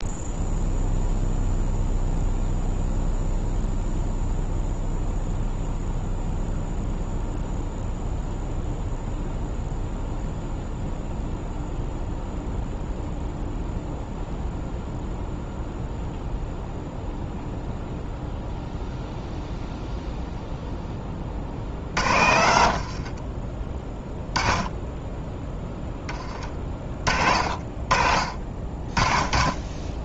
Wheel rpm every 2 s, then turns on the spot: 0, 0, 0, 0, 0, 0, 0, 0, 0, 0, 0, 60, 10, 40, 40.
22-24